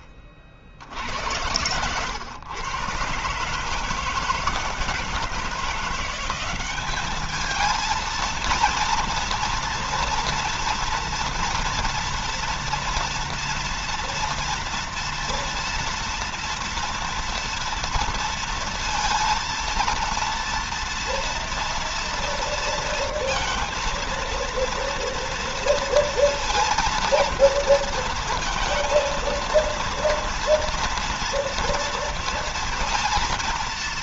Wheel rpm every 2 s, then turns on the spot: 90, 140, 160, 210, 230, 230, 230, 230, 230, 230, 230, 230, 230, 230, 230, 230, 230.
none